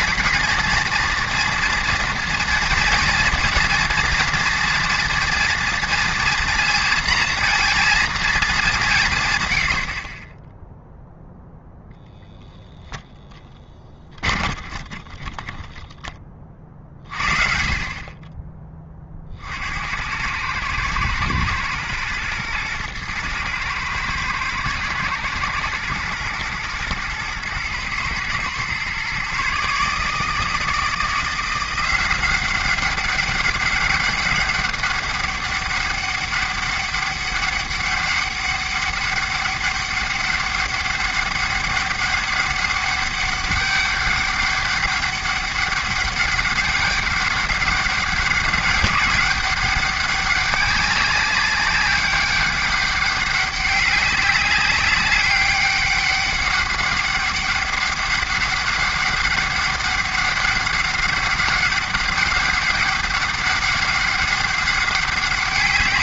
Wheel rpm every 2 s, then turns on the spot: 230, 230, 230, 230, 190, 0, 10, 20, 40, 20, 110, 110, 110, 110, 120, 160, 190, 200, 200, 200, 200, 200, 200, 200, 190, 200, 200, 200, 200, 200, 200, 190, 200.
14-16